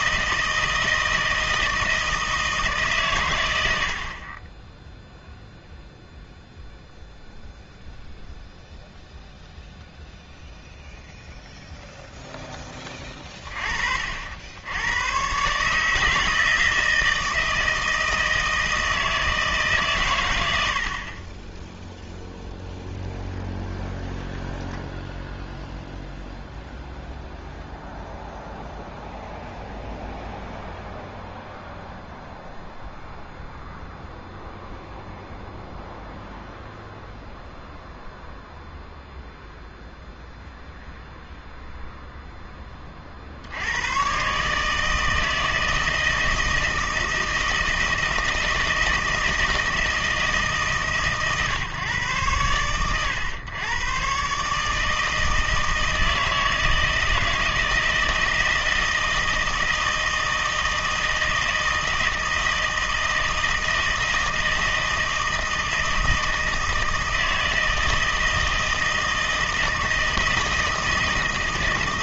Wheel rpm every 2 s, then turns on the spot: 160, 150, 10, 0, 0, 0, 10, 100, 160, 160, 70, 0, 0, 0, 0, 0, 0, 0, 0, 0, 0, 30, 160, 160, 160, 150, 100, 150, 160, 160, 160, 160, 160, 160, 160, 160.
none